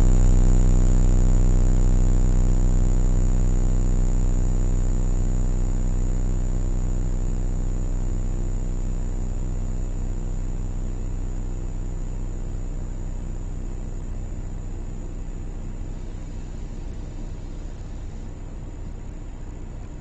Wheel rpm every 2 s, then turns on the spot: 0, 0, 0, 0, 0, 0, 0, 0, 0, 0.
none